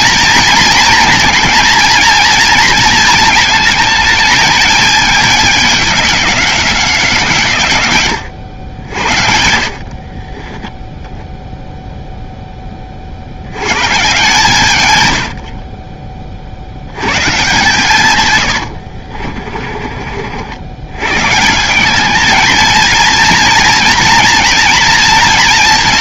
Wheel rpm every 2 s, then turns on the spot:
230, 230, 220, 190, 80, 10, 20, 130, 70, 100, 90, 220, 230.
18-20